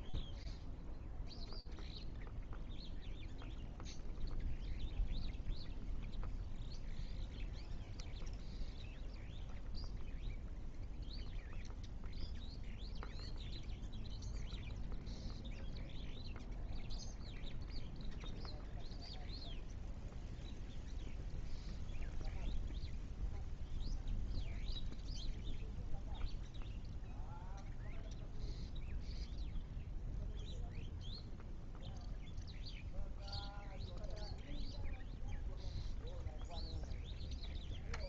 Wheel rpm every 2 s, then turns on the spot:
0, 0, 0, 0, 0, 0, 0, 0, 0, 0, 0, 0, 0, 0, 0, 0, 0, 0, 0.
none